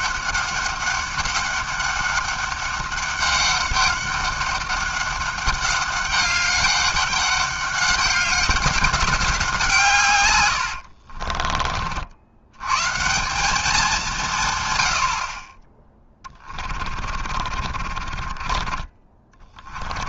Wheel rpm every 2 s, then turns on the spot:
200, 200, 200, 200, 190, 40, 180, 50, 40, 20.
10-12 16-20